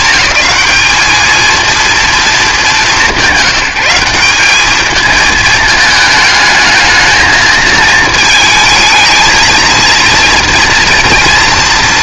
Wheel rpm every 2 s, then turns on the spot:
210, 210, 200, 220, 220, 240.
none